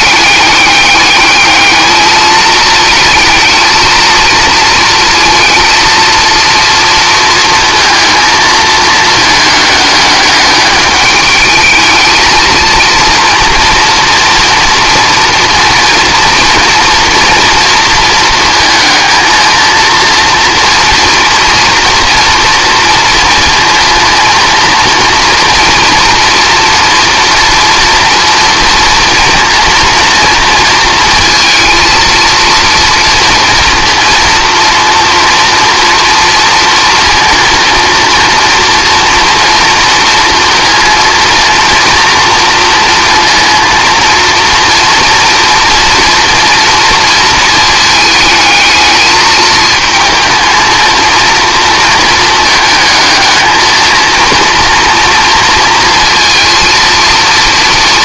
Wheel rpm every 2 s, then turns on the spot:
210, 220, 230, 230, 220, 210, 230, 230, 230, 230, 230, 230, 230, 230, 230, 230, 230, 230, 230, 240, 230, 230, 230, 230, 220, 220, 220, 230, 230.
none